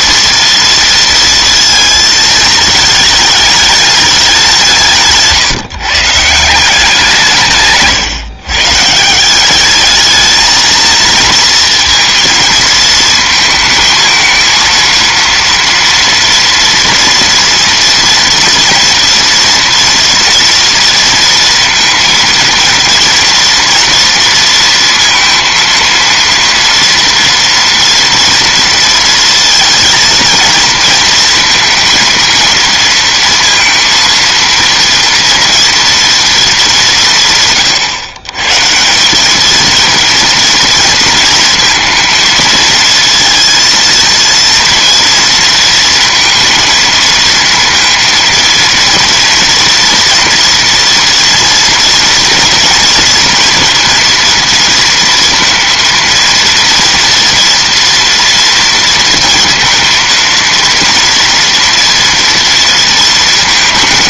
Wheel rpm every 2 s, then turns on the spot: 230, 220, 160, 180, 160, 230, 220, 230, 240, 230, 230, 230, 230, 230, 230, 230, 230, 230, 190, 160, 230, 230, 230, 230, 230, 230, 230, 230, 230, 230, 230, 230.
none